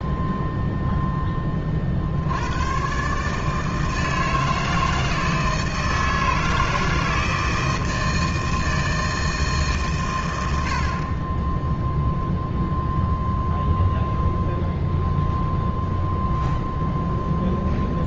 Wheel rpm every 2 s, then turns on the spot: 0, 110, 160, 160, 160, 80, 0, 0, 0.
none